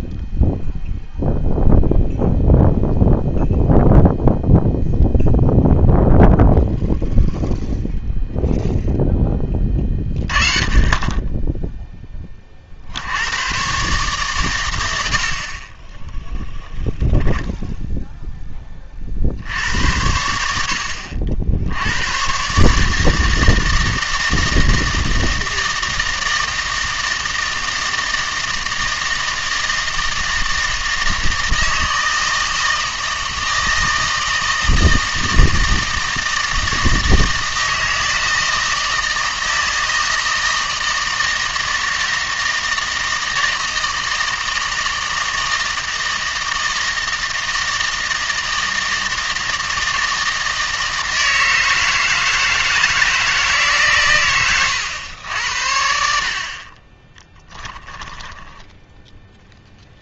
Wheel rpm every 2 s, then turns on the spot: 0, 0, 0, 0, 0, 30, 50, 100, 0, 30, 70, 150, 160, 160, 160, 160, 160, 160, 160, 160, 160, 160, 160, 160, 160, 160, 160, 110, 30, 10.
56-58